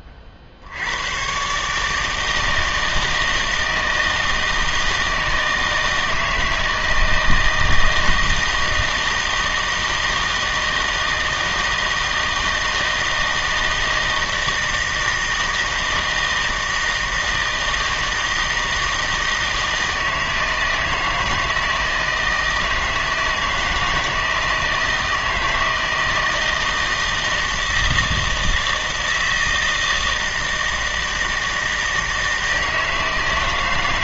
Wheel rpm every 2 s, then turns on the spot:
60, 160, 160, 160, 160, 160, 160, 160, 160, 160, 160, 160, 160, 160, 160, 160, 160.
none